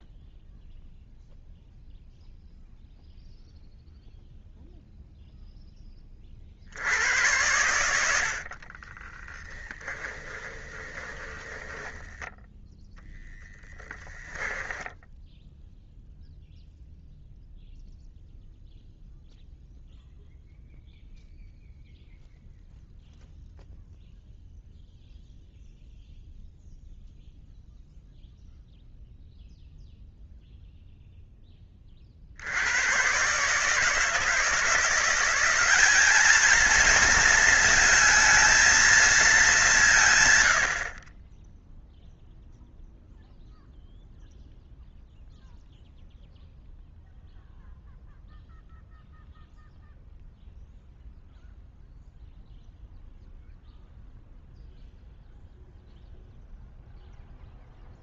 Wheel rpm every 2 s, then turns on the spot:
0, 0, 0, 60, 50, 20, 10, 20, 0, 0, 0, 0, 0, 0, 0, 0, 80, 170, 220, 220, 120, 0, 0, 0, 0, 0, 0, 0, 0.
8-16